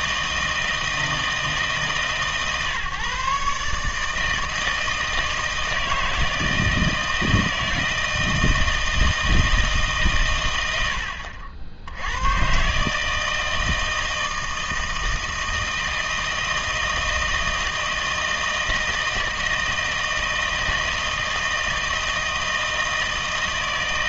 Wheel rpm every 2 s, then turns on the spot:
160, 150, 160, 160, 160, 80, 150, 160, 160, 160, 160, 160.
none